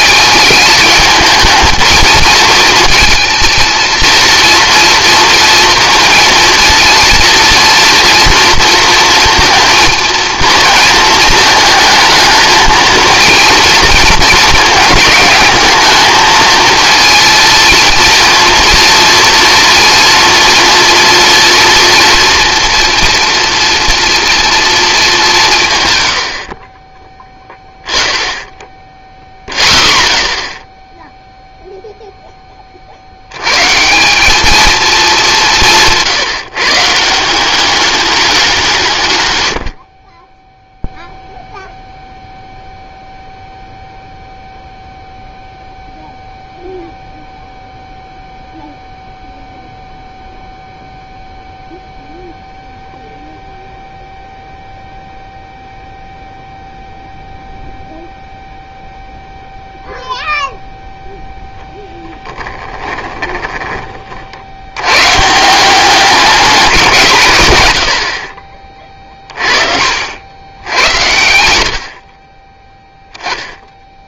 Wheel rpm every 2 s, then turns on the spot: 210, 220, 230, 230, 230, 230, 230, 220, 230, 230, 230, 240, 230, 30, 0, 0, 30, 220, 150, 170, 0, 0, 0, 0, 0, 0, 0, 0, 0, 0, 0, 10, 80, 180, 10, 90, 10.
62-64 72-74